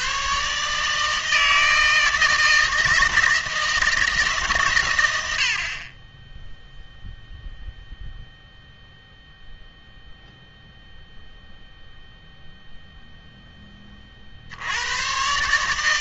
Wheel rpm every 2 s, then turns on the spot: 150, 160, 120, 0, 0, 0, 0, 90.
none